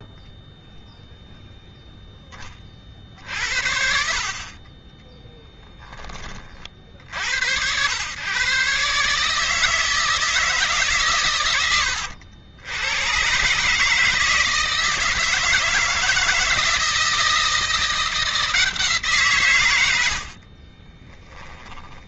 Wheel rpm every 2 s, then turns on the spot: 0, 20, 30, 40, 120, 160, 100, 160, 160, 170, 60.
20-22